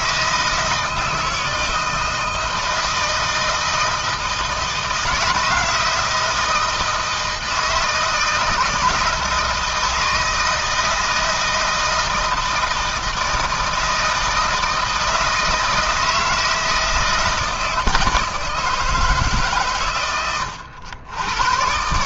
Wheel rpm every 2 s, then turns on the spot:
160, 160, 160, 160, 160, 160, 160, 160, 160, 160, 90.
none